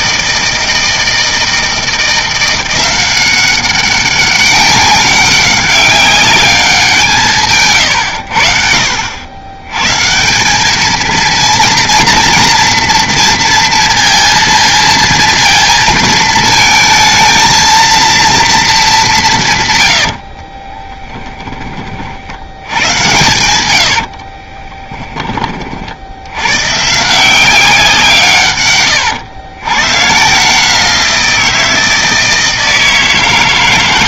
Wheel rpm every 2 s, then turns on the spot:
160, 180, 200, 190, 70, 200, 230, 230, 220, 220, 30, 100, 30, 120, 120, 160, 160.
20-22 24-26